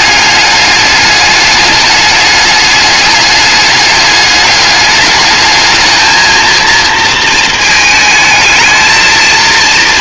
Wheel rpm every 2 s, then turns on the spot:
200, 200, 210, 230, 230.
none